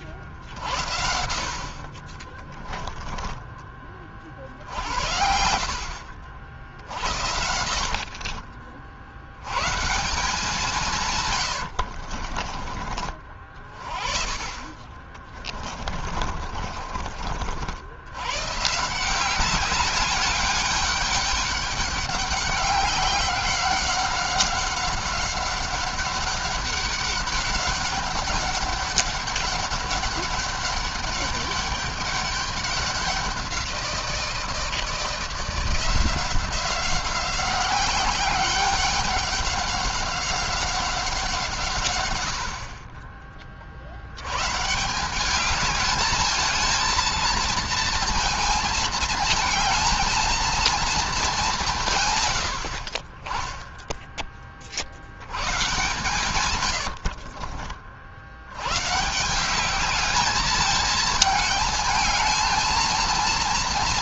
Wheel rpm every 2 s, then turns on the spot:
70, 20, 60, 70, 60, 150, 40, 30, 40, 170, 200, 190, 190, 200, 200, 200, 190, 160, 180, 190, 180, 40, 150, 230, 220, 220, 50, 50, 80, 130, 210, 230.
2-4 6-8 10-12 14-18 56-58